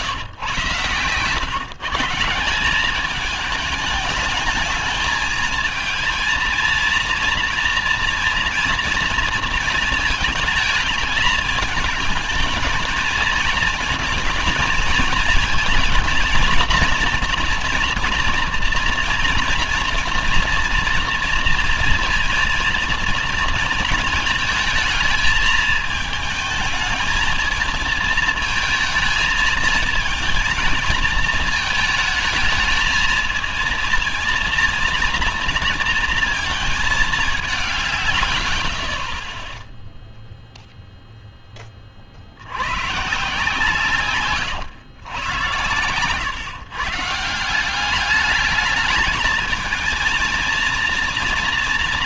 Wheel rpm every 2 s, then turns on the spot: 120, 200, 210, 230, 230, 210, 220, 220, 240, 230, 230, 230, 220, 220, 220, 230, 220, 230, 210, 50, 0, 120, 110, 150, 220, 230.
none